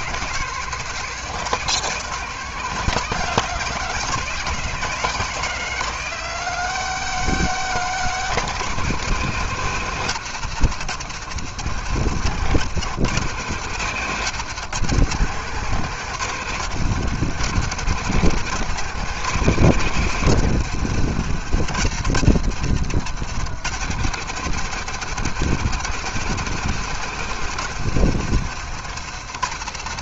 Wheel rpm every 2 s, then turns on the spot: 170, 170, 170, 180, 160, 140, 140, 140, 140, 150, 130, 130, 150, 150, 140.
none